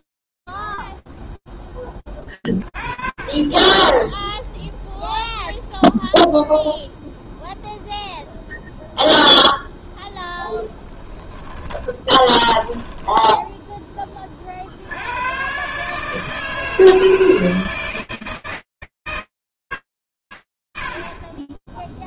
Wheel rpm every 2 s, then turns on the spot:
0, 30, 0, 0, 0, 10, 10, 100, 160, 150, 70.
10-14